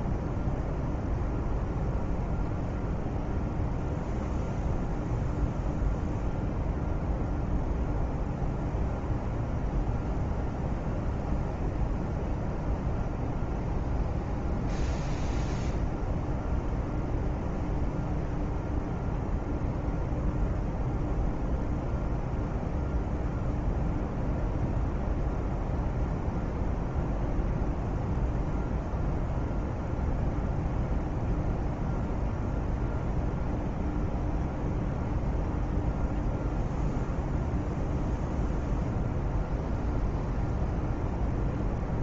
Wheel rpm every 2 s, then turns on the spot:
0, 0, 0, 0, 0, 0, 0, 0, 0, 0, 0, 0, 0, 0, 0, 0, 0, 0, 0, 0, 0.
none